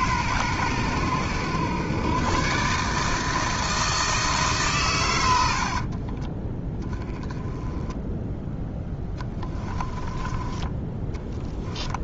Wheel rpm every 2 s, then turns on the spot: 100, 150, 120, 10, 10, 20.
6-10